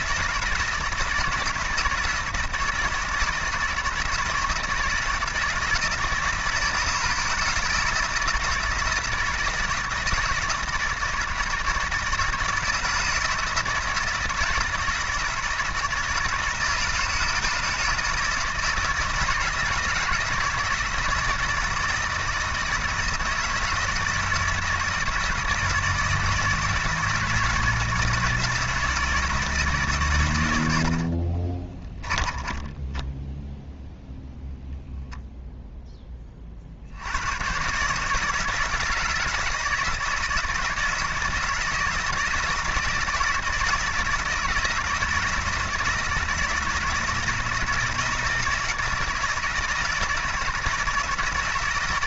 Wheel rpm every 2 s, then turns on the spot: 160, 160, 160, 170, 160, 160, 160, 160, 160, 160, 160, 160, 160, 160, 160, 90, 30, 10, 50, 160, 160, 160, 160, 170, 160, 160.
32-34